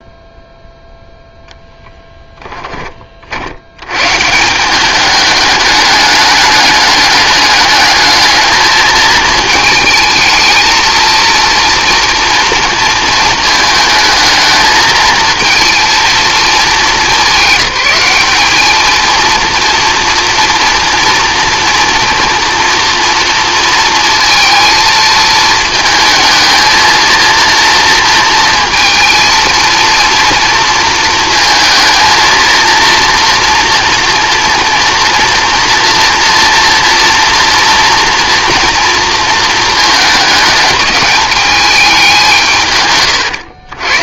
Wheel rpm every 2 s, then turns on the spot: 0, 30, 200, 210, 220, 220, 230, 220, 210, 220, 230, 230, 230, 230, 230, 230, 230, 230, 230, 230, 210, 130.
none